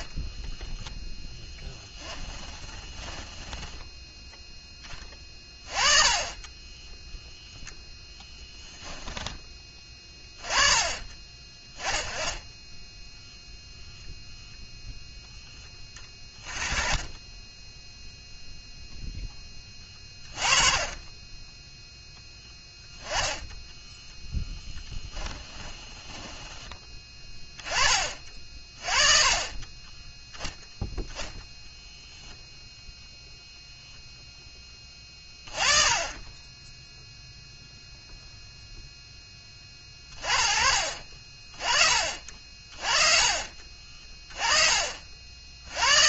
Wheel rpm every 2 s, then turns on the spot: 10, 20, 10, 10, 10, 20, 10, 0, 20, 0, 20, 10, 10, 10, 30, 0, 0, 10, 10, 0, 30, 40, 40.
0-4 6-10 16-18 22-26